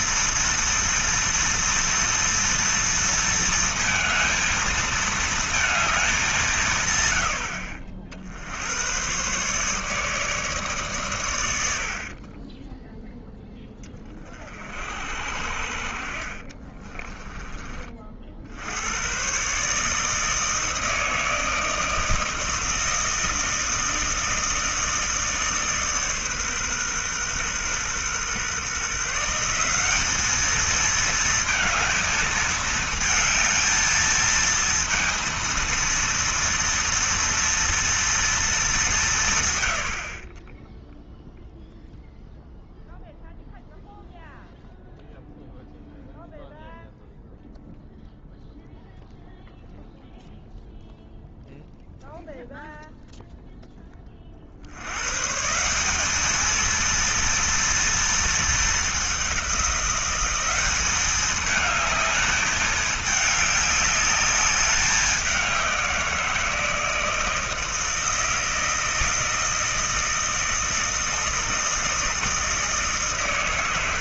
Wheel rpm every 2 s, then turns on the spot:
230, 230, 220, 150, 90, 130, 10, 50, 30, 80, 160, 160, 160, 130, 140, 220, 220, 230, 230, 200, 10, 0, 0, 0, 0, 0, 0, 80, 230, 210, 200, 210, 200, 160, 160, 160, 150.
16-18